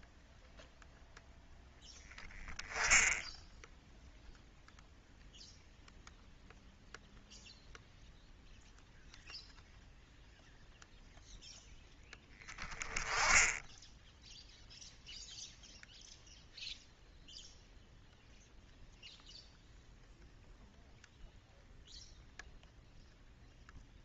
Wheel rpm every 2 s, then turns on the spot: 0, 10, 0, 0, 0, 0, 10, 0, 0, 0, 0, 0.
none